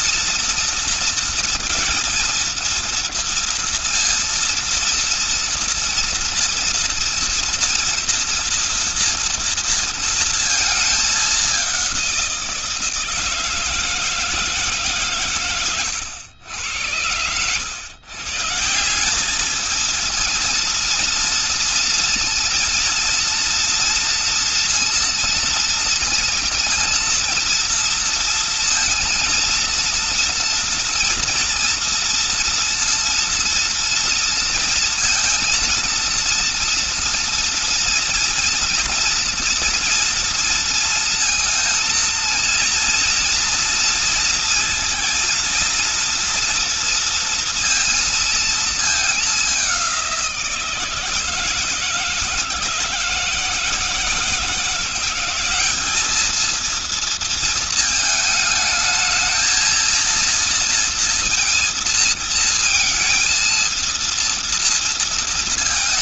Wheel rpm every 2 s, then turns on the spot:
230, 230, 230, 230, 230, 230, 180, 160, 90, 140, 230, 230, 230, 230, 230, 230, 230, 230, 230, 230, 230, 230, 230, 230, 220, 170, 160, 160, 220, 220, 230, 230, 230.
none